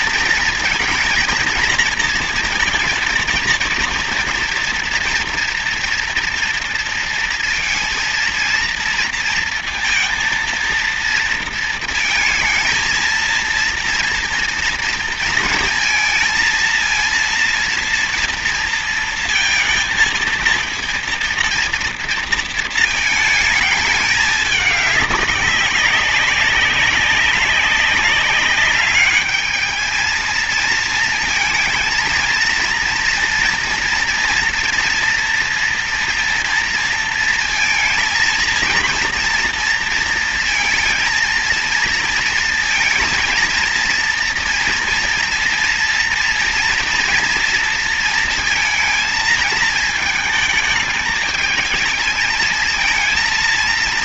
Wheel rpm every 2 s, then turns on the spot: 230, 230, 230, 230, 230, 230, 220, 230, 230, 230, 230, 220, 210, 200, 200, 220, 230, 230, 230, 230, 230, 230, 230, 230, 230, 220, 220.
none